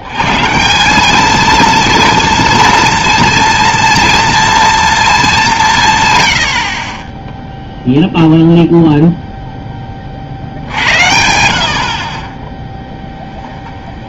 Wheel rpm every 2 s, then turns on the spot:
150, 220, 210, 40, 0, 70, 20.
6-8